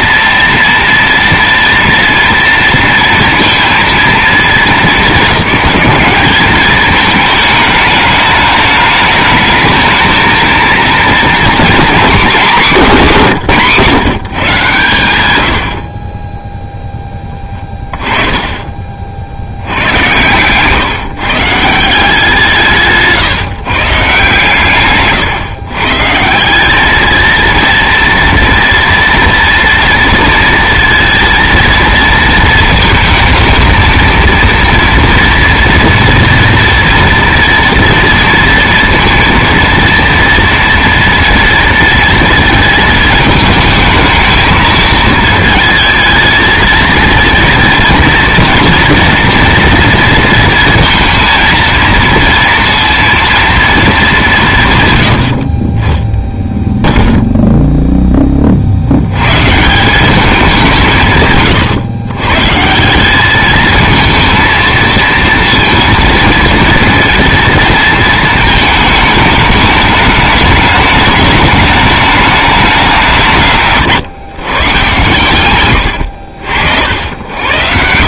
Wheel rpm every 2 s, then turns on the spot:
230, 230, 220, 210, 210, 220, 220, 150, 10, 30, 130, 170, 140, 190, 230, 230, 230, 230, 230, 230, 230, 220, 220, 220, 230, 230, 230, 130, 0, 60, 190, 170, 230, 230, 220, 210, 200, 140, 70.
18-20 24-26